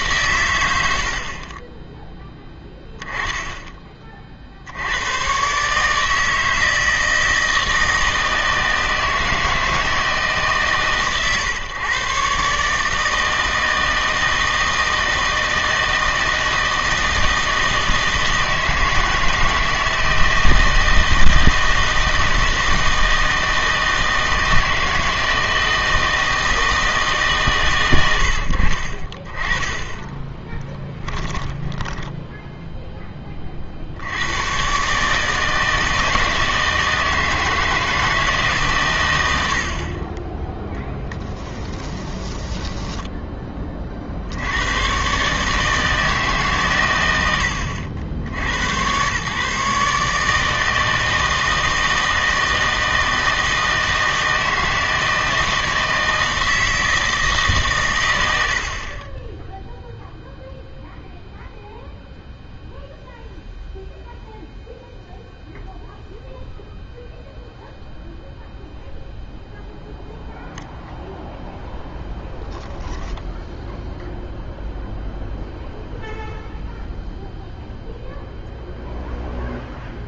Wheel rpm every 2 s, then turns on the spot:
90, 0, 70, 160, 160, 140, 150, 160, 160, 160, 160, 160, 160, 160, 50, 10, 0, 130, 160, 120, 10, 10, 110, 120, 100, 160, 160, 160, 160, 60, 0, 0, 0, 0, 0, 0, 10, 0, 0, 0.
30-32 40-44